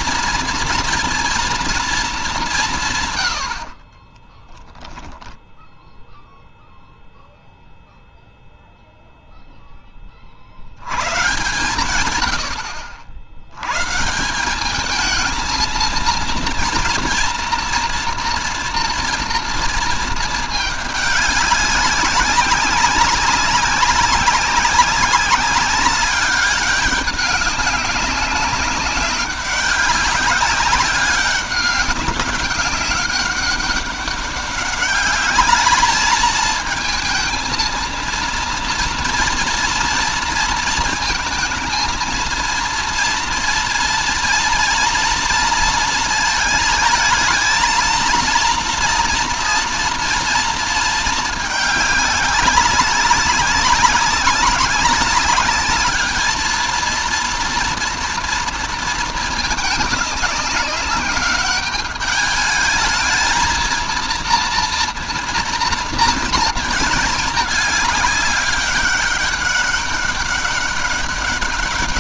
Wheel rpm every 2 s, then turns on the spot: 230, 180, 20, 0, 0, 70, 90, 200, 230, 230, 210, 200, 190, 200, 200, 200, 200, 200, 220, 230, 230, 230, 230, 230, 230, 230, 200, 200, 220, 230, 200, 210, 230, 220, 200, 200.
4-6